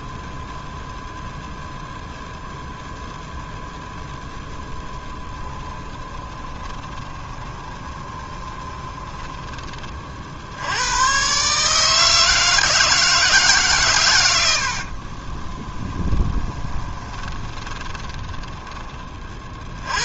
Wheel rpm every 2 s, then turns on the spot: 0, 0, 10, 20, 20, 110, 160, 50, 20, 30.
4-10 14-18